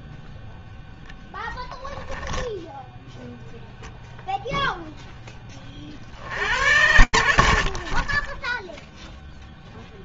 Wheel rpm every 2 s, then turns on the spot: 0, 0, 20, 90, 0.
none